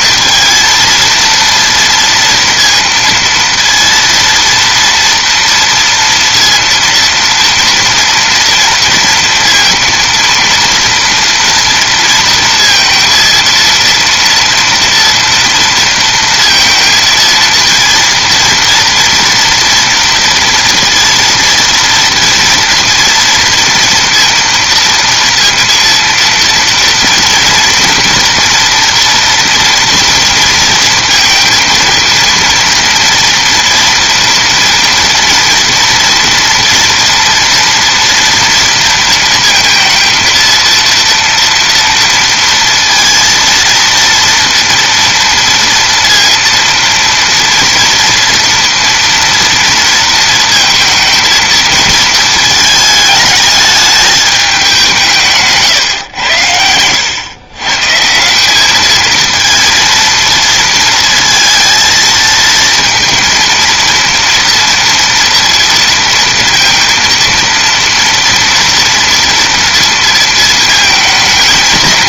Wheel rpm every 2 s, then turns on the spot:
230, 230, 230, 230, 230, 230, 230, 230, 230, 230, 230, 230, 230, 230, 230, 230, 230, 230, 230, 230, 230, 230, 230, 230, 230, 230, 220, 190, 90, 210, 230, 230, 230, 230, 230, 220.
none